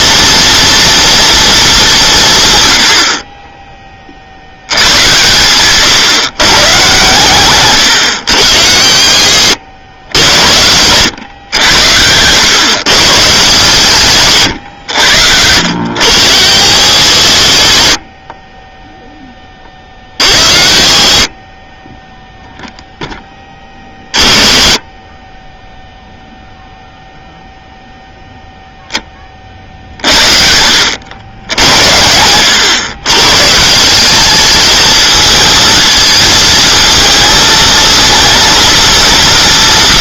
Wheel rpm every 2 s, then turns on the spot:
240, 100, 100, 130, 70, 100, 120, 100, 90, 10, 40, 0, 20, 0, 0, 80, 110, 220, 230, 230.
none